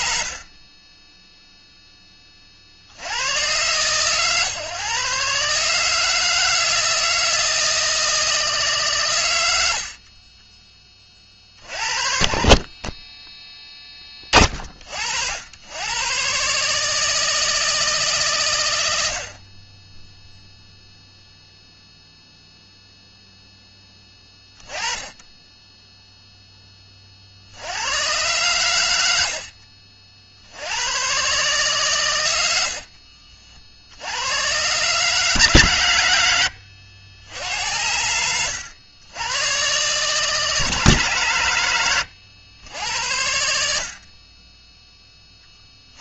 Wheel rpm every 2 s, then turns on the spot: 20, 70, 140, 160, 130, 30, 30, 60, 150, 90, 0, 0, 10, 30, 90, 110, 50, 140, 80, 110, 140, 80, 10.
32-34